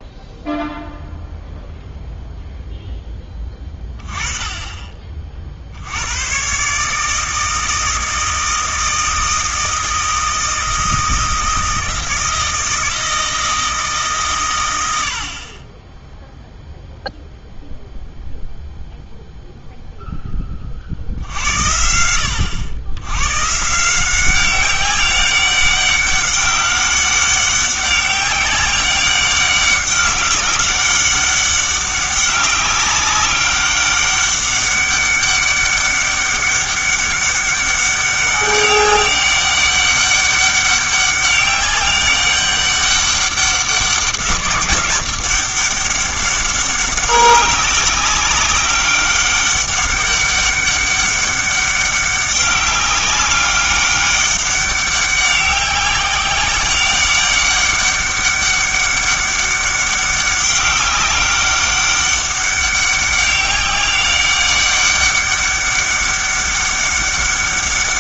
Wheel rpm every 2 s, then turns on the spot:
0, 0, 30, 140, 160, 160, 160, 100, 0, 0, 40, 90, 190, 200, 190, 190, 190, 200, 200, 200, 200, 200, 200, 200, 200, 200, 200, 200, 190, 200, 200, 200, 200, 200.
none